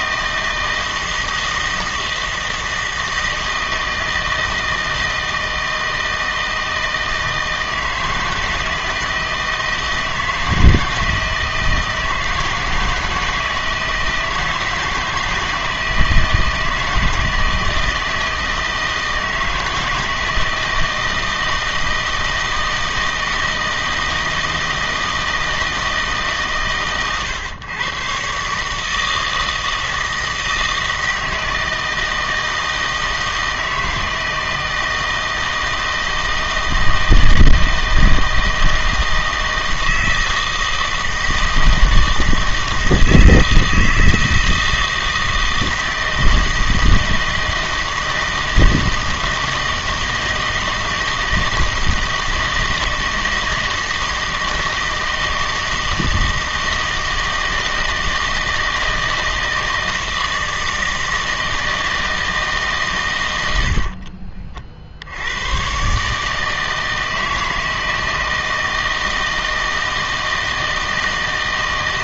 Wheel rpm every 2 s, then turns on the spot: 160, 160, 160, 160, 160, 160, 160, 160, 160, 160, 160, 160, 160, 140, 140, 160, 160, 160, 160, 160, 160, 160, 160, 160, 160, 160, 160, 160, 160, 160, 160, 150, 50, 160, 160, 160.
none